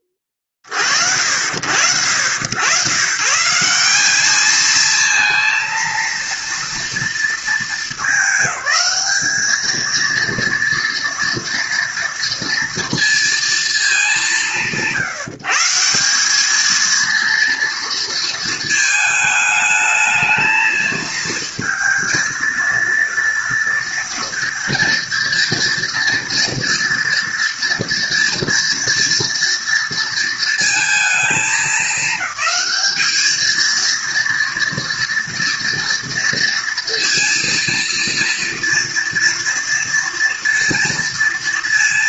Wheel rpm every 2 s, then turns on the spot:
30, 110, 220, 230, 210, 230, 230, 150, 220, 220, 220, 230, 230, 230, 230, 230, 210, 230, 230, 230, 230.
none